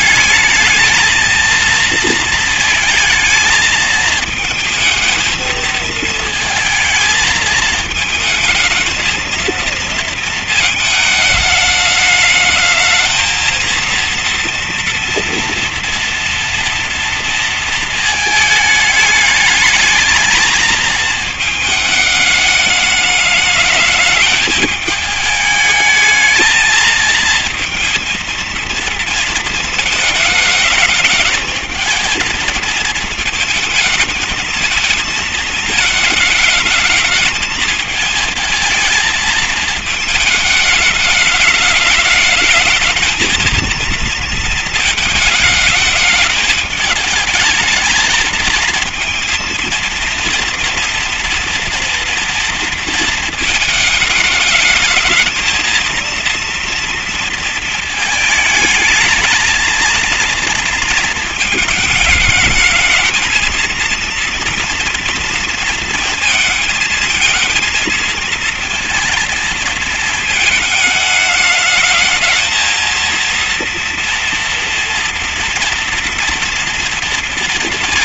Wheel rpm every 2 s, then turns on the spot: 220, 220, 220, 220, 220, 230, 220, 230, 230, 220, 220, 210, 210, 220, 230, 220, 220, 220, 210, 220, 210, 220, 230, 220, 230, 230, 230, 210, 230, 220, 230, 220, 230, 220, 230, 220, 220, 230, 230.
none